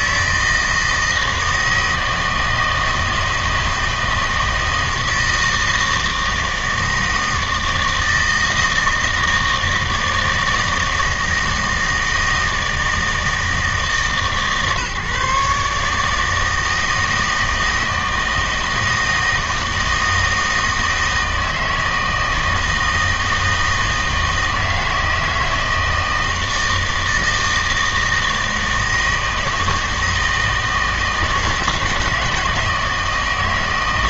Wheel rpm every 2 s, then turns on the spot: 160, 160, 160, 160, 160, 160, 160, 150, 160, 160, 160, 160, 160, 160, 160, 160, 160.
none